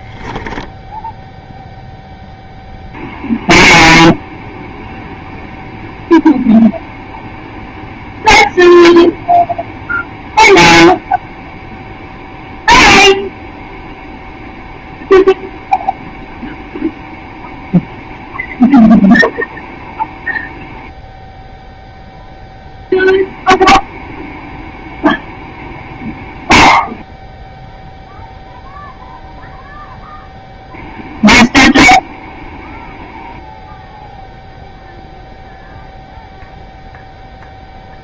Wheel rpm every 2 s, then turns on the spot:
0, 0, 0, 0, 0, 0, 0, 0, 0, 0, 0, 0, 0, 0, 0, 0, 0, 0, 0.
none